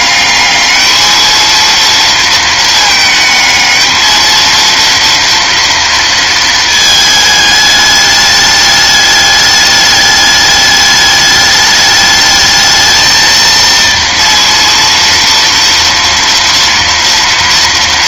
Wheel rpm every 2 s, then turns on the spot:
210, 220, 230, 220, 210, 210, 220, 230, 230.
none